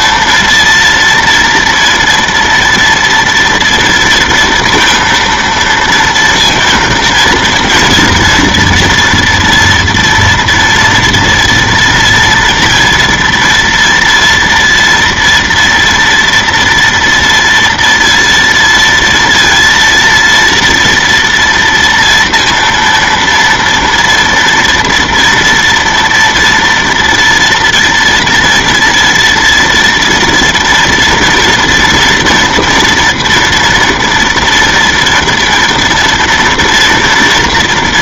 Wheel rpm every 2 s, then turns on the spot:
230, 230, 230, 230, 230, 230, 230, 230, 240, 230, 230, 230, 230, 230, 230, 230, 230, 230, 230.
none